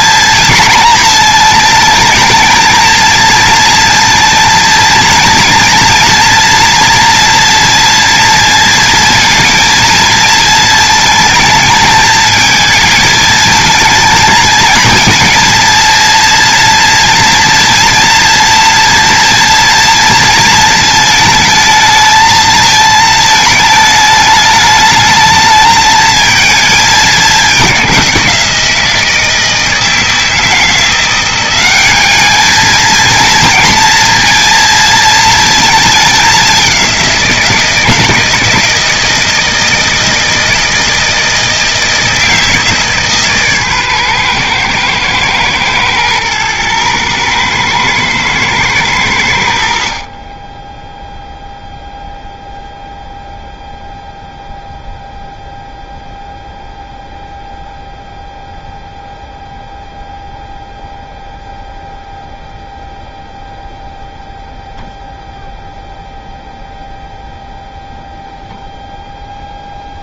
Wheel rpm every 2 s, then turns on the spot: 220, 220, 230, 230, 230, 220, 220, 220, 230, 230, 220, 220, 210, 210, 170, 170, 220, 230, 190, 160, 160, 150, 110, 110, 100, 0, 0, 0, 0, 0, 0, 0, 0, 0, 0.
none